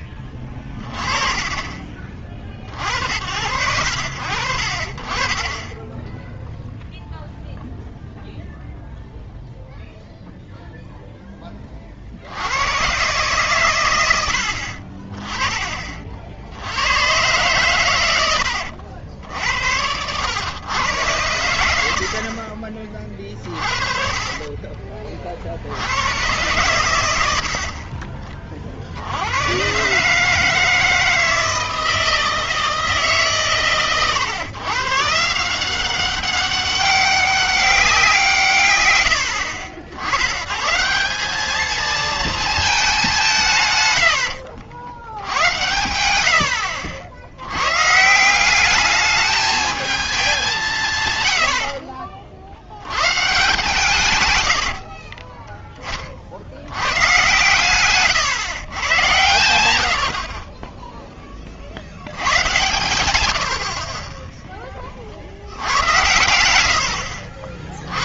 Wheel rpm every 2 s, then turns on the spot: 30, 40, 0, 0, 0, 40, 110, 30, 120, 70, 70, 30, 60, 60, 100, 160, 140, 160, 200, 80, 210, 150, 80, 90, 210, 110, 130, 20, 100, 110, 0, 110, 10, 90.
22-24 26-28 38-40 54-56 66-68